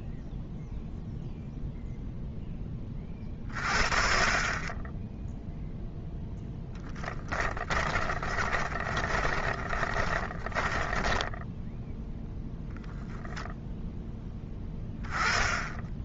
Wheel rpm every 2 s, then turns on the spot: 0, 20, 20, 10, 30, 20, 0, 20.
6-12